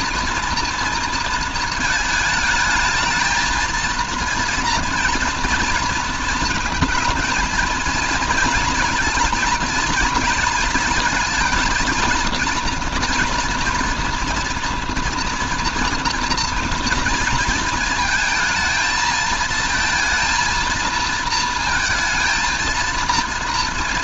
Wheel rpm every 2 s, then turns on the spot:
230, 220, 230, 230, 230, 220, 230, 230, 230, 220, 230, 230.
none